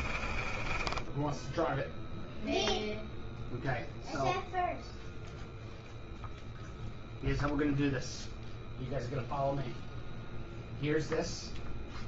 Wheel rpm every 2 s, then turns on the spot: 20, 0, 0, 0, 0, 0.
0-2